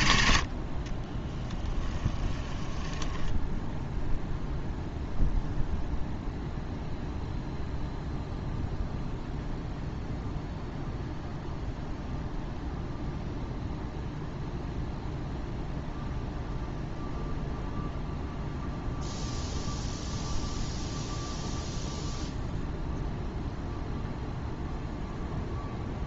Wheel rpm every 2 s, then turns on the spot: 30, 10, 0, 0, 0, 0, 0, 0, 0, 0, 0, 0, 0.
0-4